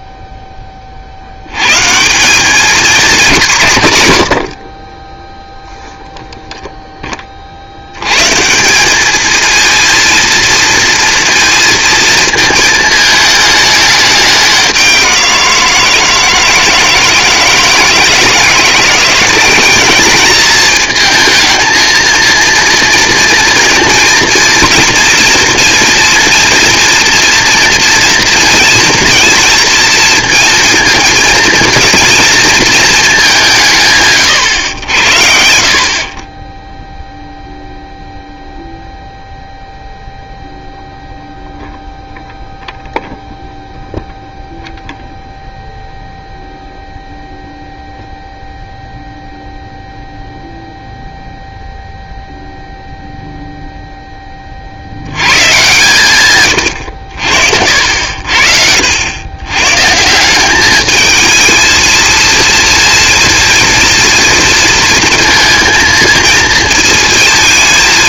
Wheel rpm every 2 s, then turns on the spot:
30, 210, 50, 0, 180, 230, 220, 200, 160, 170, 210, 230, 230, 230, 230, 220, 230, 120, 20, 0, 0, 0, 0, 0, 0, 0, 0, 60, 100, 70, 200, 230, 230, 220.
56-58